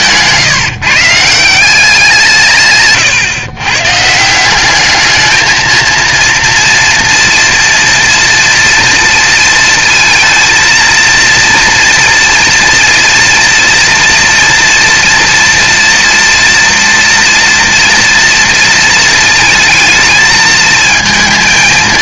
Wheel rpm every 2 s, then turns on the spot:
160, 140, 190, 240, 230, 230, 240, 230, 230, 230, 220.
none